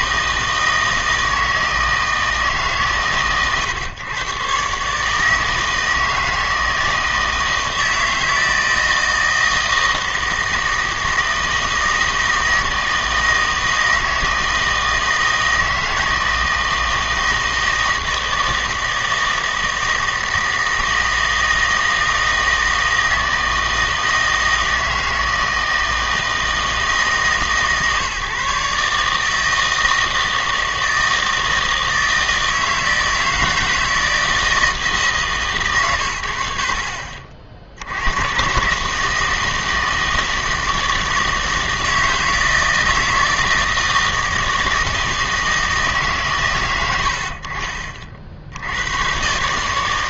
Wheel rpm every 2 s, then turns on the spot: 160, 140, 140, 160, 160, 160, 160, 160, 160, 160, 160, 160, 160, 160, 150, 160, 160, 160, 50, 150, 160, 160, 160, 80, 100.
none